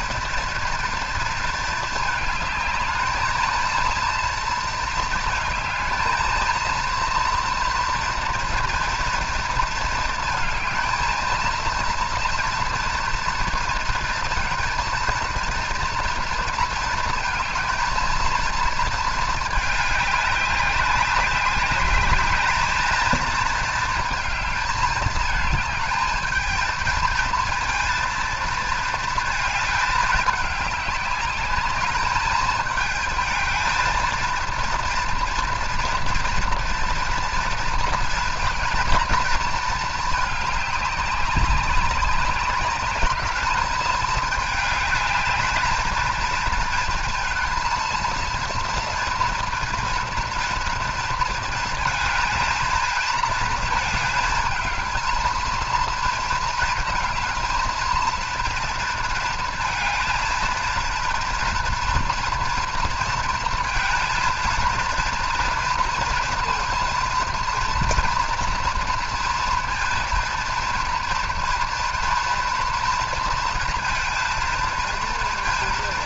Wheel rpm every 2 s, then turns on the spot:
230, 220, 230, 230, 230, 220, 230, 230, 220, 220, 190, 220, 220, 220, 230, 200, 220, 230, 230, 230, 200, 200, 210, 230, 230, 230, 220, 220, 220, 230, 230, 230, 230, 230, 230, 230, 230, 230.
none